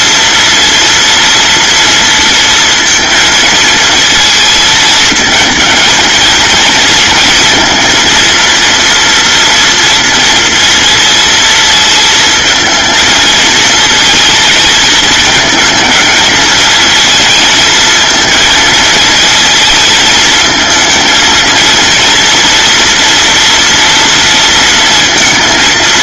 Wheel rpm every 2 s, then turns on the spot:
230, 230, 220, 230, 230, 230, 220, 220, 220, 230, 230, 230, 230.
none